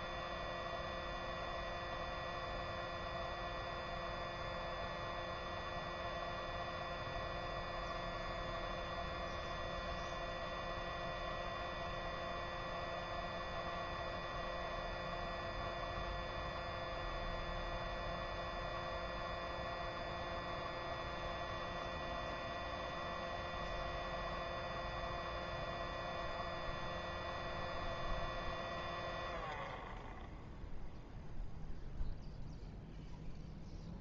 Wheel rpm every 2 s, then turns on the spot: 0, 0, 0, 0, 0, 0, 0, 0, 0, 0, 0, 0, 0, 0, 0, 0, 0.
none